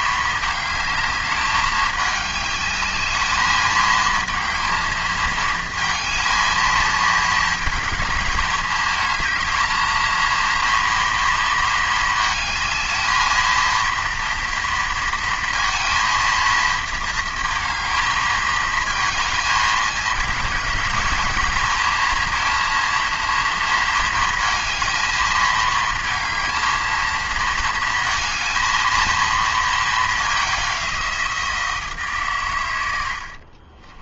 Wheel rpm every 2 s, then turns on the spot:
220, 210, 230, 220, 210, 230, 220, 230, 230, 220, 220, 230, 230, 220, 230, 190, 100.
none